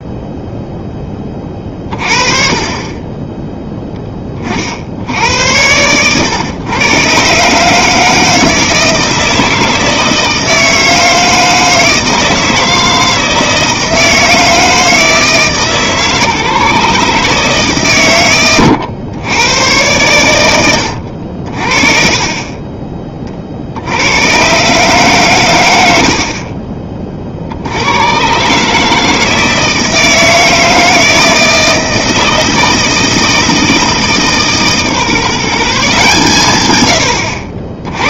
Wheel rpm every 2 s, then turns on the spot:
0, 30, 50, 120, 160, 160, 160, 160, 140, 110, 90, 20, 140, 30, 150, 160, 160, 150, 110.
none